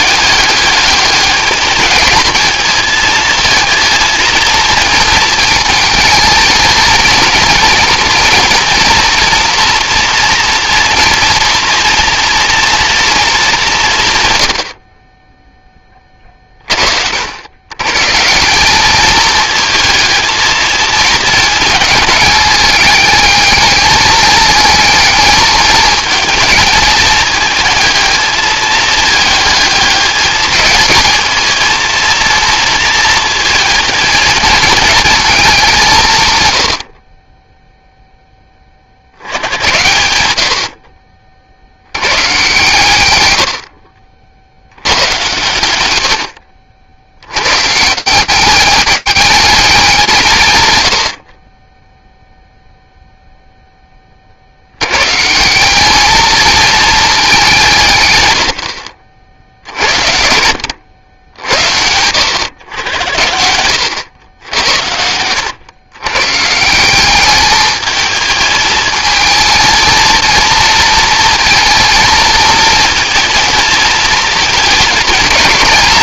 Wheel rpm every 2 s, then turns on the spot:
210, 220, 220, 230, 240, 230, 220, 20, 60, 210, 220, 210, 220, 220, 210, 220, 230, 220, 30, 50, 50, 120, 90, 90, 210, 60, 0, 140, 210, 70, 80, 80, 80, 200, 220, 230, 230, 220.
none